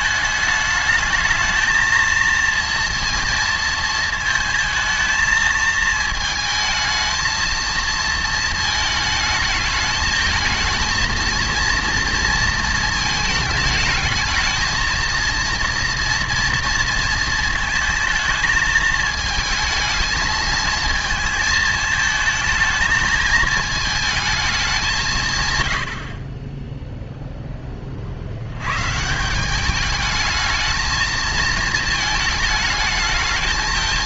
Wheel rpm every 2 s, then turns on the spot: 220, 230, 220, 220, 220, 220, 220, 230, 230, 220, 220, 220, 180, 0, 140, 220, 220.
none